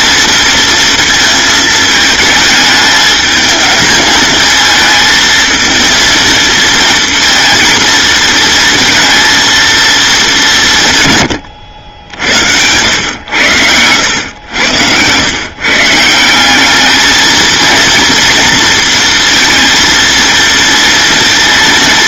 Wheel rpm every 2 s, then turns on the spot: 230, 220, 220, 230, 230, 150, 100, 100, 210, 230, 230.
12-14